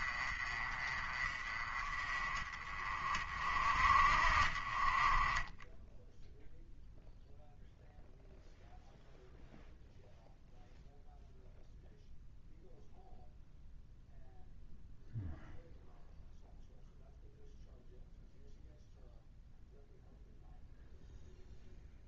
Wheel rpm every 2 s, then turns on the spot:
30, 30, 30, 0, 0, 0, 0, 0, 0, 0, 0.
none